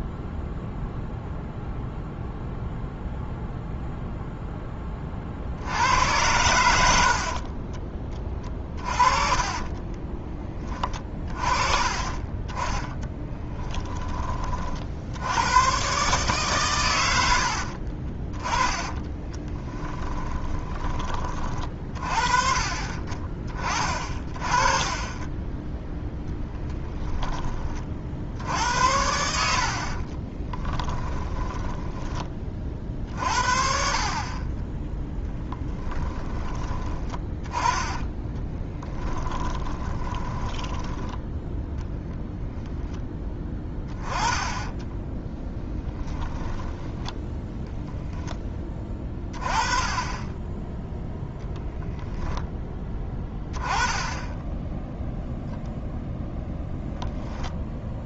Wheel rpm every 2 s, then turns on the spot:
0, 0, 20, 80, 30, 20, 10, 60, 110, 20, 20, 30, 30, 10, 80, 20, 40, 10, 20, 10, 10, 10, 10, 10, 10, 10, 10, 0, 0.
8-10 12-14 18-20 26-28 30-32 36-42